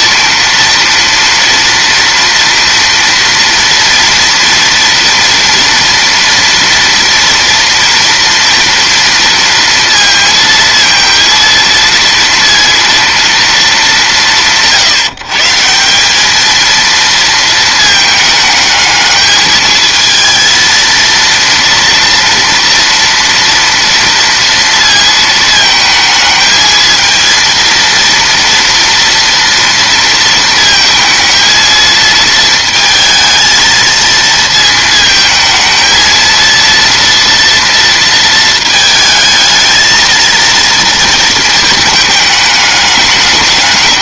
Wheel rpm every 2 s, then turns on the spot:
230, 230, 230, 240, 230, 230, 230, 170, 220, 210, 230, 230, 230, 220, 230, 220, 220, 220, 230, 220, 230, 210.
none